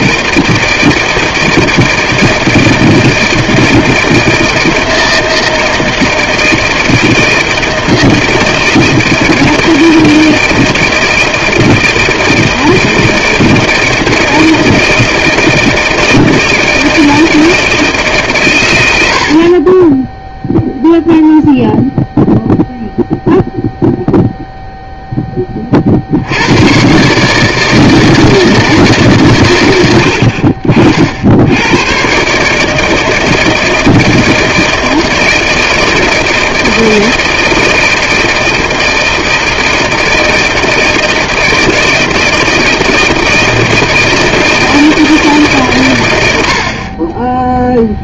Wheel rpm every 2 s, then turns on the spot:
160, 160, 160, 160, 160, 160, 160, 160, 160, 100, 0, 0, 0, 120, 150, 60, 160, 160, 160, 160, 160, 160, 160, 50.
none